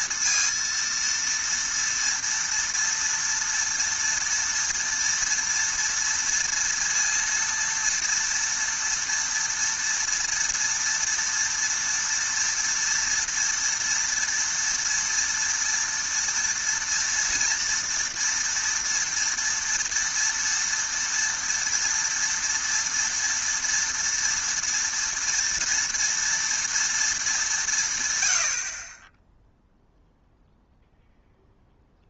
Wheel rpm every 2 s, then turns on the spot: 230, 230, 230, 230, 230, 230, 230, 230, 230, 230, 230, 230, 230, 230, 120, 0.
none